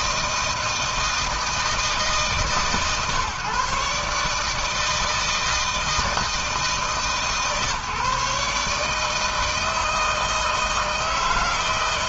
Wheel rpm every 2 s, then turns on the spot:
160, 140, 160, 140, 160, 160.
none